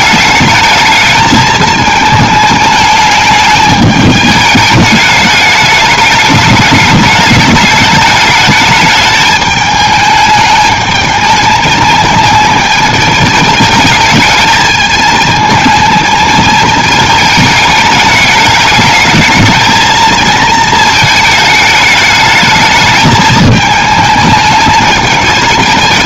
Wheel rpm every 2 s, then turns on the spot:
210, 210, 210, 210, 210, 210, 220, 220, 220, 210, 220, 220, 210.
none